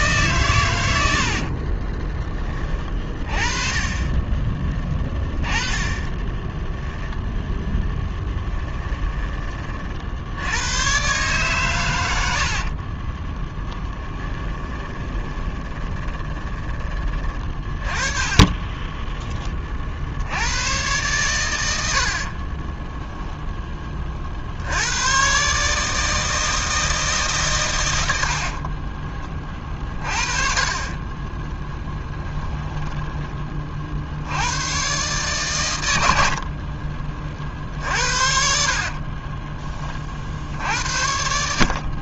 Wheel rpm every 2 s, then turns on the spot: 90, 20, 20, 0, 10, 110, 40, 20, 20, 20, 120, 20, 80, 160, 30, 30, 10, 120, 40, 40, 70.
4-6 8-10 14-16 18-20 22-24 28-34 36-40